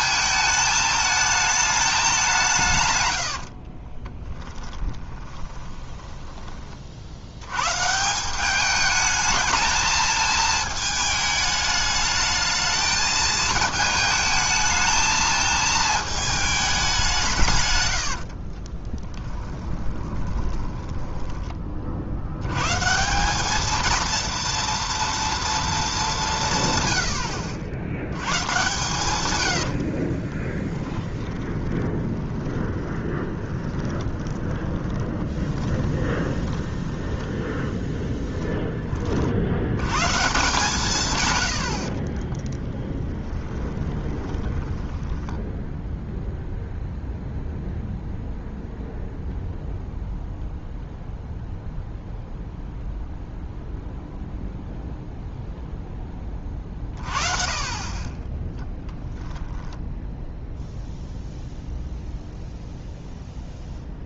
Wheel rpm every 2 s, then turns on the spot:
220, 150, 10, 40, 210, 220, 220, 220, 200, 40, 20, 140, 230, 120, 130, 20, 20, 20, 10, 20, 150, 10, 10, 0, 0, 0, 0, 0, 40, 10, 0, 0.
4-6 18-22 30-38 42-46 58-60